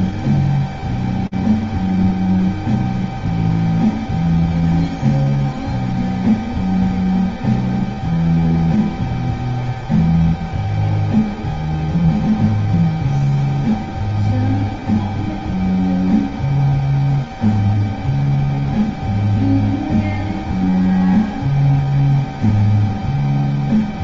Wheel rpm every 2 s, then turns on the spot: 0, 0, 0, 0, 0, 0, 0, 0, 0, 0, 0, 0.
none